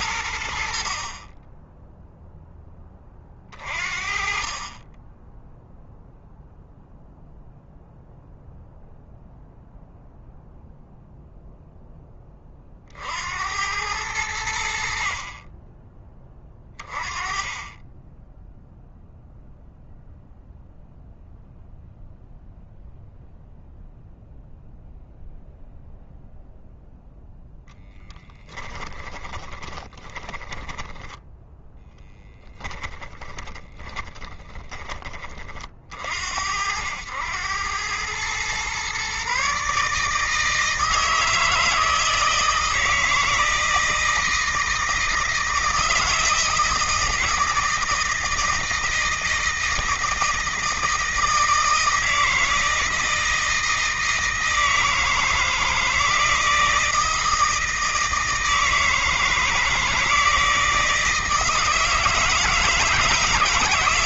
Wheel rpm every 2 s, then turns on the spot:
40, 20, 20, 0, 0, 0, 60, 70, 30, 0, 0, 0, 0, 0, 10, 10, 30, 30, 80, 130, 160, 160, 160, 160, 160, 160, 160, 160, 160, 160, 160, 160.
28-34